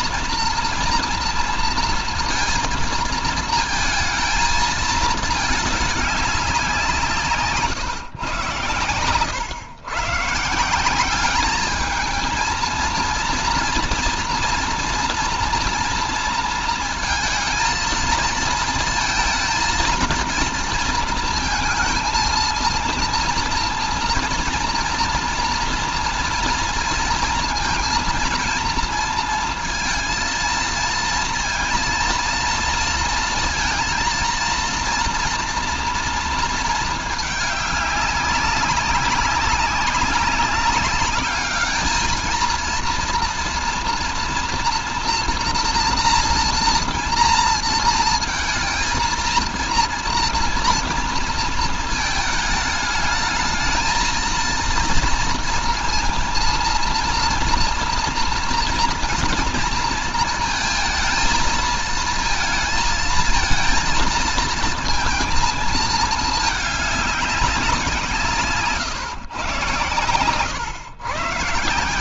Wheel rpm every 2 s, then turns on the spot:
240, 230, 220, 180, 120, 170, 230, 230, 230, 220, 230, 230, 230, 230, 230, 220, 230, 230, 220, 190, 200, 230, 230, 230, 230, 230, 220, 230, 230, 230, 220, 230, 230, 210, 140, 120.
none